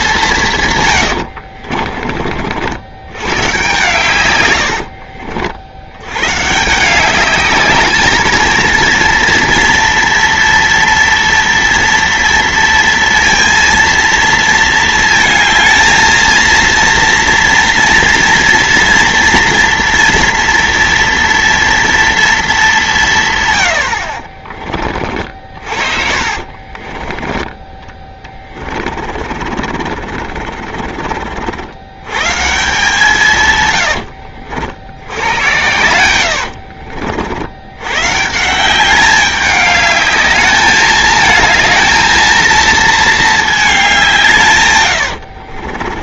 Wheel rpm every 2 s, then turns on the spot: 140, 60, 90, 140, 230, 230, 230, 220, 230, 230, 230, 210, 50, 30, 30, 40, 140, 90, 60, 170, 210, 230, 140.
0-2 4-6 24-32 36-38 44-46